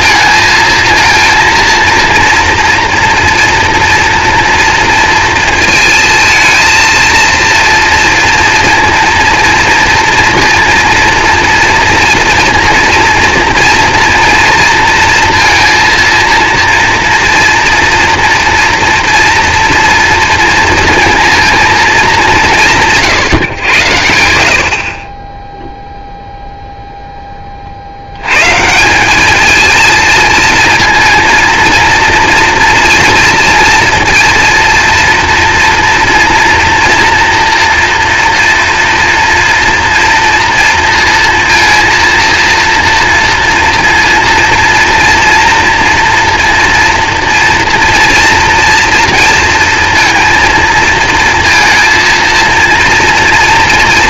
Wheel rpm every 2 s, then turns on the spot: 220, 230, 230, 230, 230, 230, 230, 230, 230, 230, 230, 160, 40, 0, 160, 220, 230, 230, 240, 230, 230, 230, 240, 230, 230, 230, 230.
none